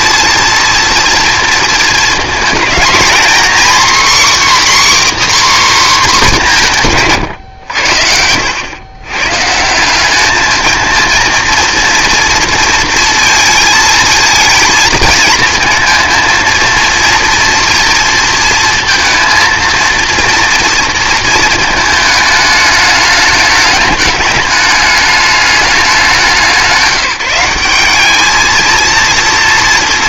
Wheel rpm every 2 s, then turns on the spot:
230, 220, 290, 180, 100, 220, 230, 230, 230, 230, 230, 210, 210, 170, 220.
none